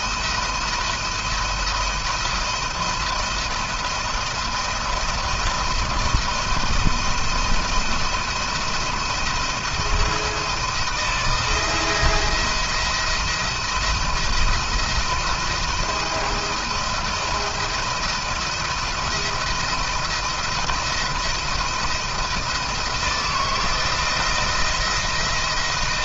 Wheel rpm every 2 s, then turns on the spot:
170, 170, 170, 170, 170, 170, 170, 170, 170, 170, 170, 160, 170.
none